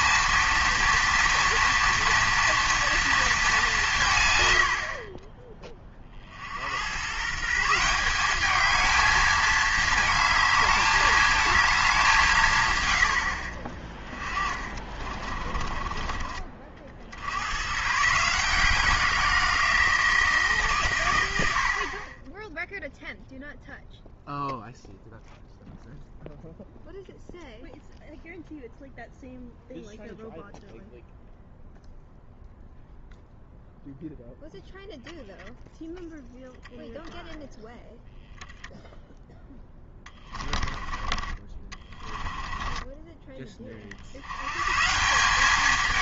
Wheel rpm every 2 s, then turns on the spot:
230, 230, 90, 70, 210, 220, 130, 30, 40, 170, 140, 0, 0, 0, 0, 0, 0, 0, 10, 0, 20, 20, 130.
14-16 40-44